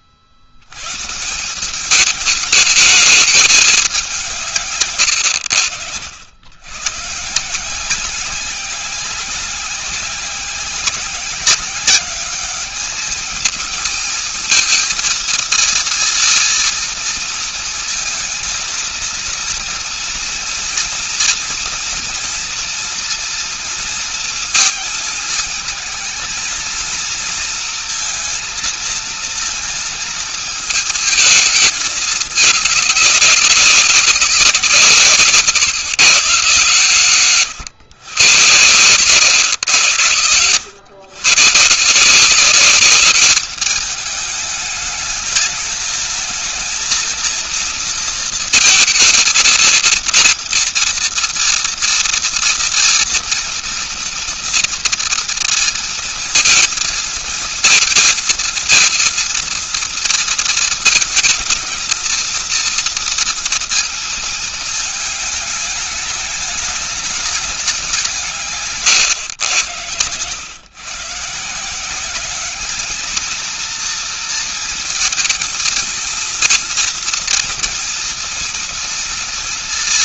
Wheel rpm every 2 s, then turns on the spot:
130, 210, 130, 110, 190, 190, 210, 230, 230, 230, 230, 230, 220, 230, 230, 220, 200, 160, 140, 120, 110, 200, 210, 230, 230, 230, 230, 230, 230, 230, 220, 230, 210, 210, 140, 140, 220, 230, 230, 230.
none